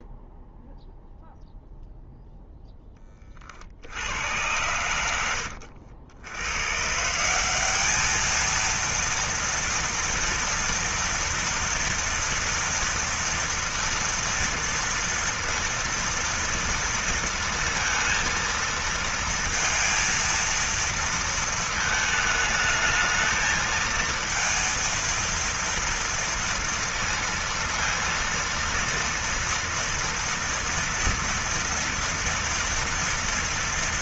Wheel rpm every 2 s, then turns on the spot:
0, 10, 120, 110, 220, 240, 240, 230, 230, 230, 230, 210, 230, 230, 230, 230, 230.
none